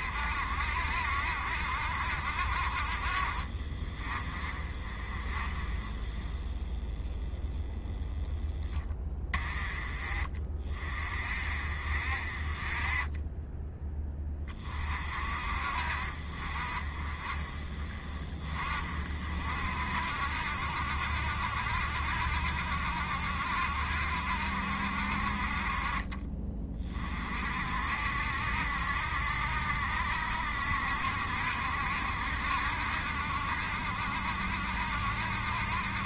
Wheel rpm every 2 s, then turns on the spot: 60, 50, 30, 10, 10, 30, 30, 30, 40, 40, 70, 70, 60, 30, 60, 70, 70, 70.
none